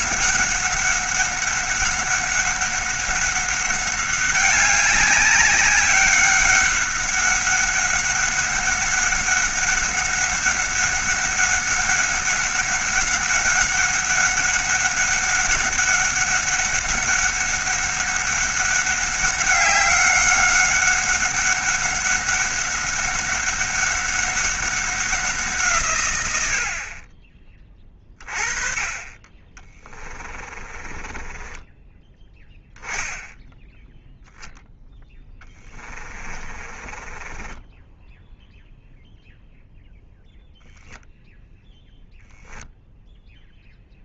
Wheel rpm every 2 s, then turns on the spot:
190, 190, 200, 200, 200, 200, 190, 200, 200, 200, 200, 200, 190, 70, 30, 20, 10, 0, 20, 0, 0, 0.
30-32 36-38